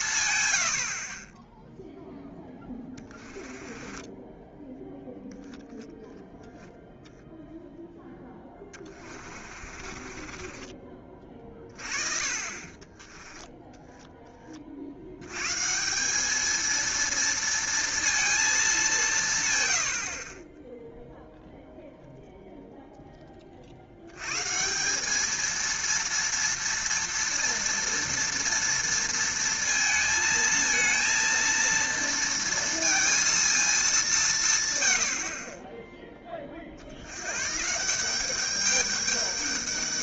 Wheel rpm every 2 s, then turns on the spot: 90, 10, 10, 0, 20, 30, 30, 40, 220, 210, 10, 0, 160, 230, 230, 220, 230, 130, 40, 200.
2-6 8-14